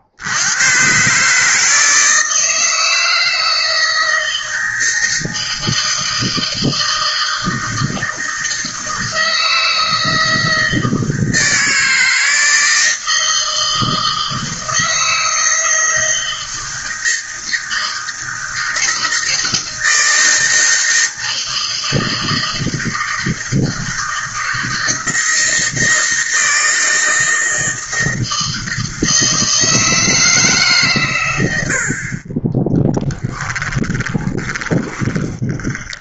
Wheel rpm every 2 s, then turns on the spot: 130, 160, 160, 160, 160, 160, 160, 160, 160, 160, 160, 160, 160, 160, 160, 130, 10, 10.
32-36